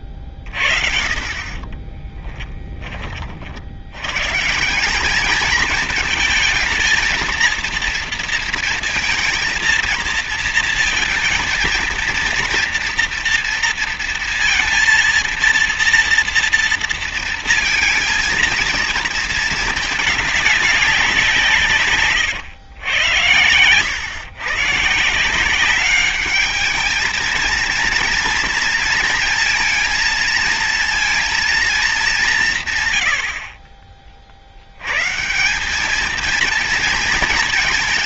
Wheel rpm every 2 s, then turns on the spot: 40, 20, 170, 220, 230, 230, 230, 230, 230, 230, 200, 110, 130, 210, 230, 230, 150, 90, 230.
0-2